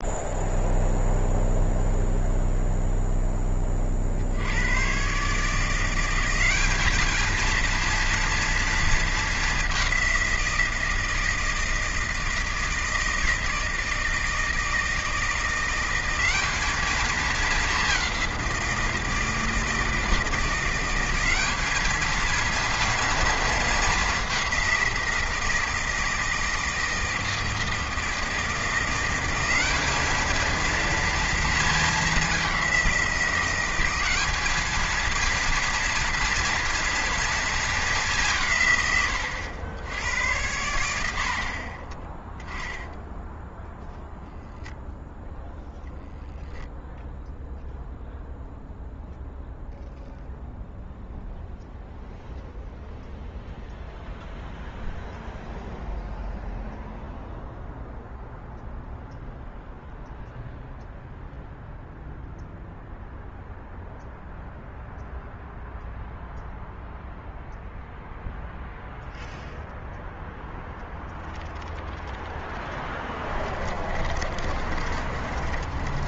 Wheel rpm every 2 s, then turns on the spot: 0, 0, 130, 220, 220, 160, 160, 170, 210, 160, 190, 230, 180, 160, 180, 230, 180, 230, 230, 110, 70, 0, 0, 0, 0, 0, 0, 0, 0, 0, 0, 0, 0, 0, 0, 0, 20, 30.
72-76